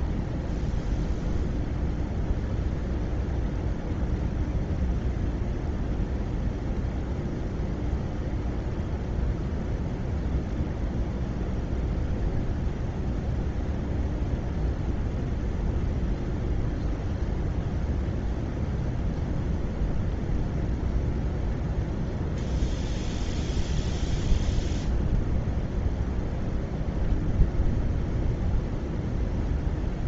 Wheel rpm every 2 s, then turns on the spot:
0, 0, 0, 0, 0, 0, 0, 0, 0, 0, 0, 0, 0, 0, 0.
none